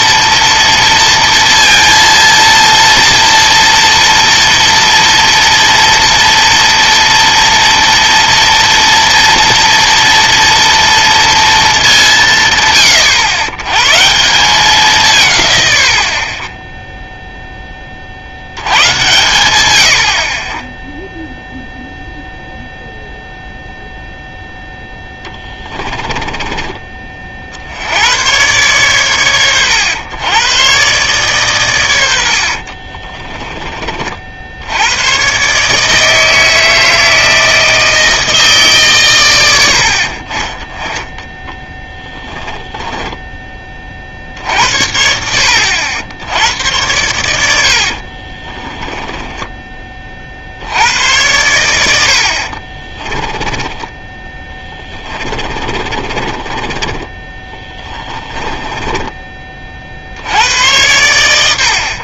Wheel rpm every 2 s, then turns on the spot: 230, 230, 230, 230, 230, 230, 140, 180, 10, 90, 20, 0, 0, 20, 110, 120, 50, 80, 160, 150, 20, 10, 60, 90, 30, 80, 40, 20, 20, 10, 80.
32-34 42-44 48-50 52-60